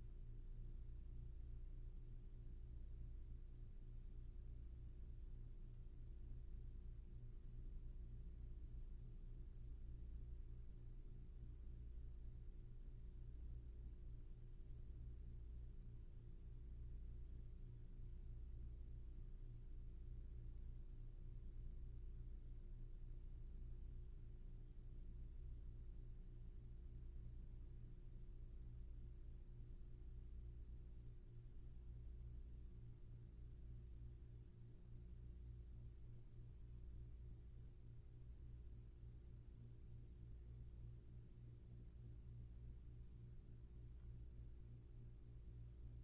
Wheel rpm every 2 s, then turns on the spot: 0, 0, 0, 0, 0, 0, 0, 0, 0, 0, 0, 0, 0, 0, 0, 0, 0, 0, 0, 0, 0, 0, 0.
none